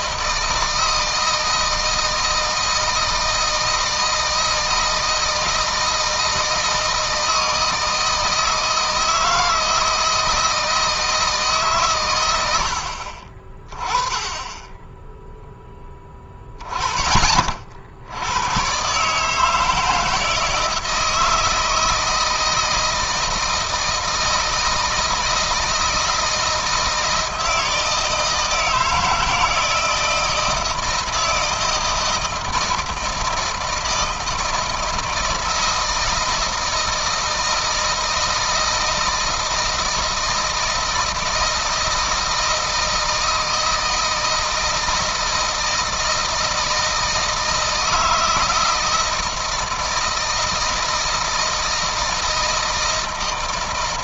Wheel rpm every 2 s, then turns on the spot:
160, 160, 160, 160, 160, 160, 70, 10, 20, 130, 160, 160, 160, 160, 170, 170, 160, 160, 160, 160, 160, 160, 160, 160, 160, 160, 160.
none